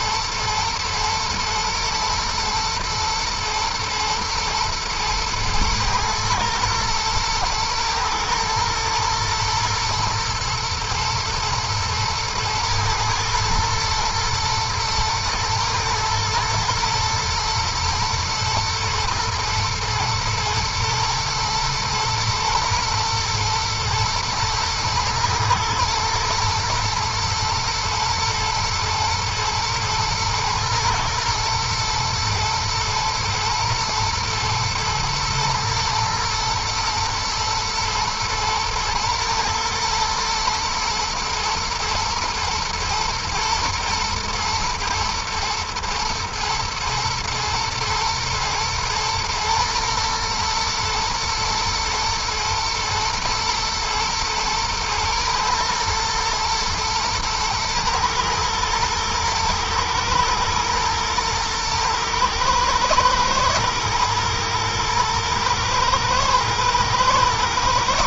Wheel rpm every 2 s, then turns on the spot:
110, 110, 110, 110, 110, 110, 110, 120, 110, 120, 120, 110, 120, 120, 120, 120, 110, 120, 120, 110, 120, 110, 110, 120, 120, 120, 120, 110, 110, 110, 110, 110, 110, 110.
none